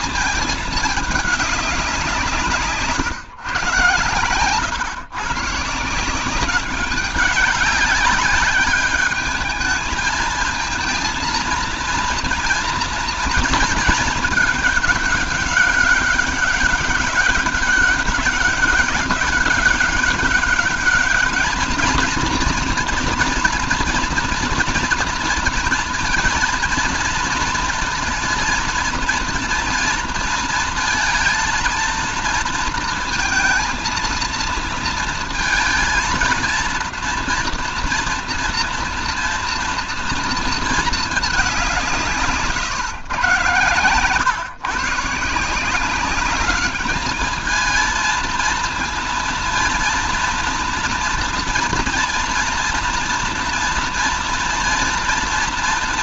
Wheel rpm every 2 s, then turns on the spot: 220, 160, 110, 180, 200, 220, 230, 210, 200, 200, 200, 230, 230, 230, 230, 230, 230, 230, 230, 240, 230, 150, 130, 200, 230, 230, 230, 230.
none